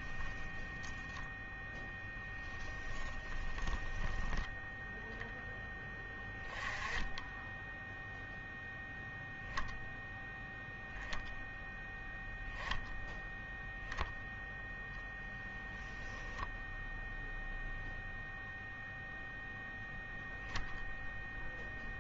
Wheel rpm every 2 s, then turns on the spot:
10, 10, 0, 20, 0, 0, 0, 10, 0, 0, 0.
2-4